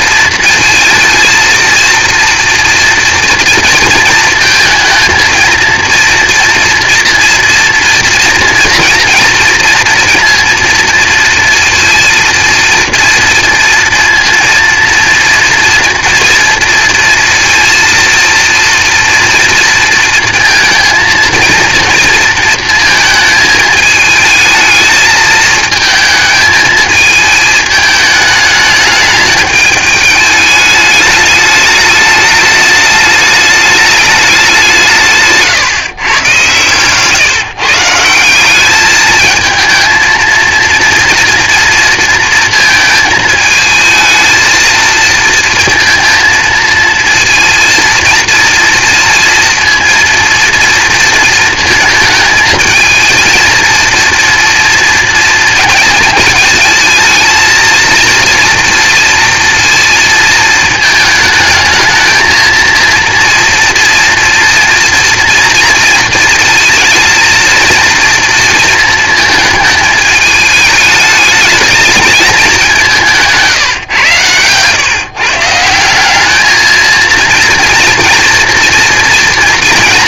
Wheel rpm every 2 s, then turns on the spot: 230, 230, 230, 230, 230, 230, 230, 230, 230, 230, 220, 220, 220, 220, 210, 210, 210, 190, 120, 200, 230, 230, 220, 220, 230, 230, 220, 230, 220, 230, 220, 230, 230, 220, 230, 210, 190, 130, 220, 230.
36-38